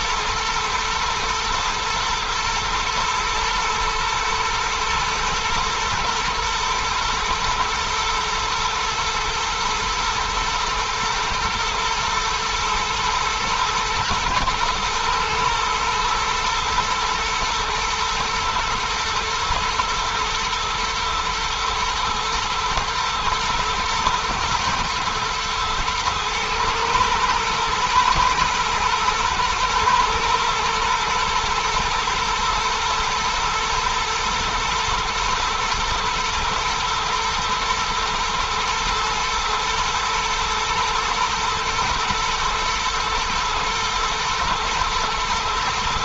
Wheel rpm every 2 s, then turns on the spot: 110, 120, 120, 120, 120, 120, 110, 110, 110, 120, 120, 120, 120, 120, 120, 110, 110, 120, 110, 110, 110, 110, 110.
none